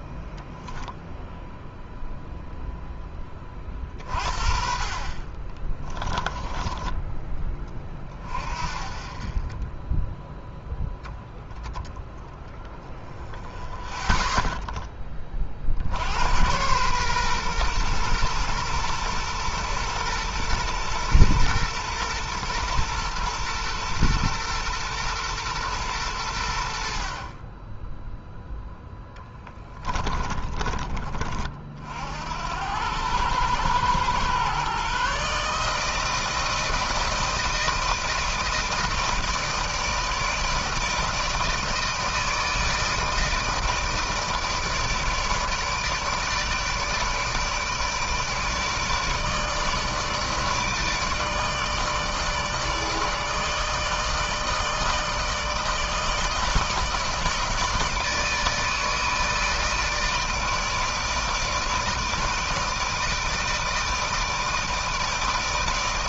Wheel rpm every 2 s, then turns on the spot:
10, 0, 40, 20, 30, 10, 10, 0, 100, 120, 120, 120, 120, 90, 10, 30, 80, 120, 160, 160, 160, 160, 160, 150, 160, 150, 150, 160, 160, 160, 160, 160, 160.
6-8 28-32